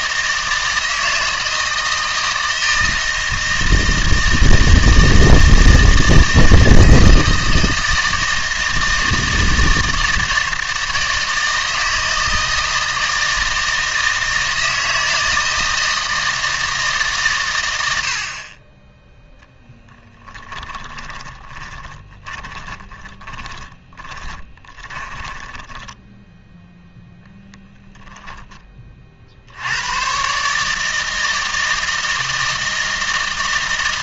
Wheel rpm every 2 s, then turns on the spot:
160, 160, 160, 160, 160, 160, 160, 160, 160, 20, 20, 20, 20, 0, 20, 150, 160.
20-26